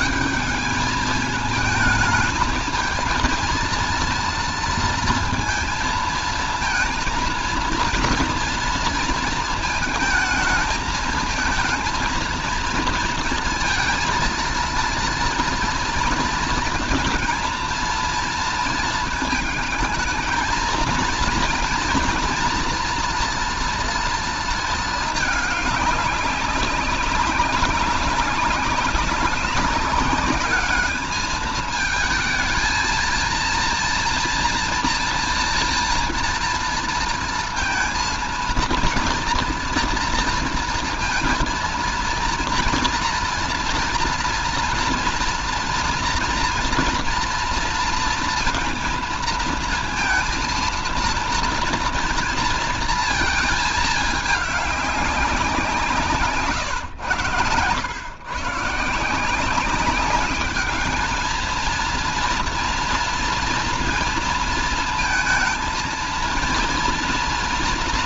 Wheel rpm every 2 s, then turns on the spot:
210, 220, 230, 220, 230, 210, 230, 230, 230, 230, 220, 230, 220, 200, 190, 210, 220, 240, 230, 230, 230, 230, 230, 240, 230, 230, 230, 210, 150, 140, 200, 230, 230, 230.
none